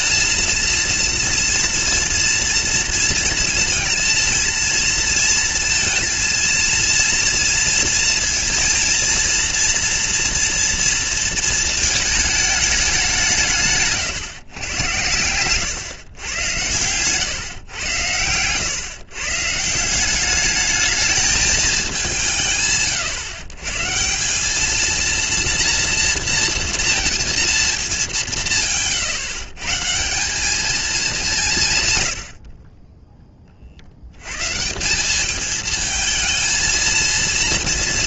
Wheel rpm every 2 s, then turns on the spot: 230, 230, 230, 230, 230, 230, 210, 130, 100, 120, 210, 150, 200, 230, 160, 210, 50, 140, 230.
none